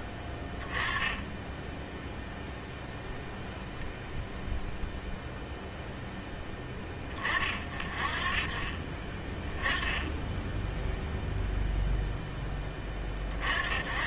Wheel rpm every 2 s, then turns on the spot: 10, 0, 0, 20, 30, 0, 0.
none